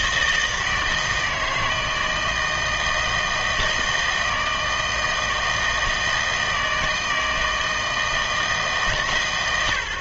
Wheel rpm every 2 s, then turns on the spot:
160, 160, 160, 160, 150.
none